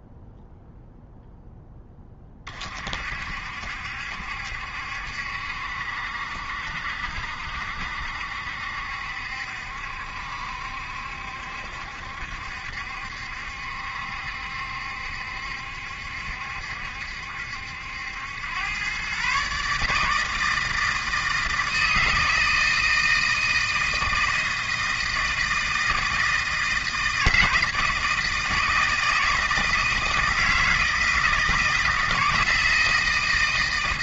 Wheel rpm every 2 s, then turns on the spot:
0, 40, 70, 70, 70, 70, 70, 70, 70, 110, 160, 160, 160, 160, 160, 160, 160.
none